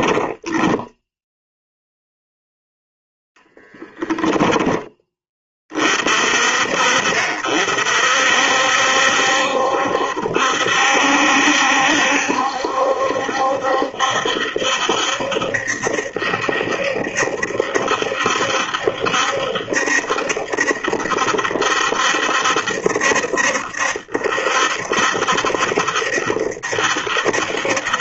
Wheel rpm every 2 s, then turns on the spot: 0, 0, 10, 50, 70, 70, 70, 70, 70, 70, 70, 70, 70, 70.
none